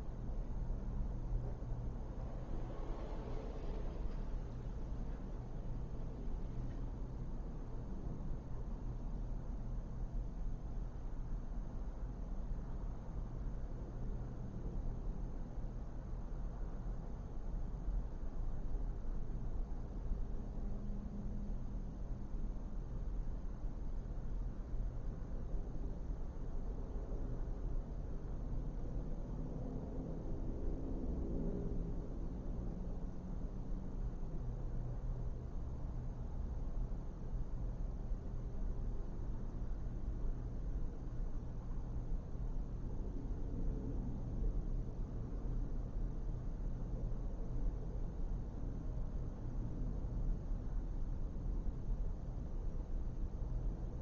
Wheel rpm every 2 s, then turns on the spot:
0, 0, 0, 0, 0, 0, 0, 0, 0, 0, 0, 0, 0, 0, 0, 0, 0, 0, 0, 0, 0, 0, 0, 0, 0, 0, 0.
none